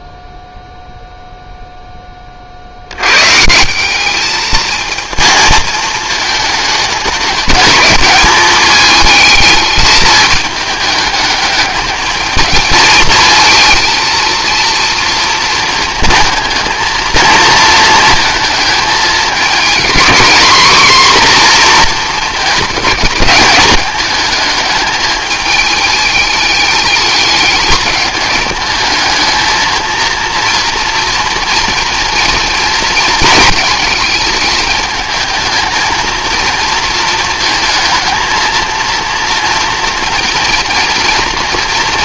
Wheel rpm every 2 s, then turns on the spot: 0, 70, 220, 210, 220, 210, 220, 230, 230, 220, 240, 210, 210, 210, 210, 230, 230, 220, 230, 230, 230.
none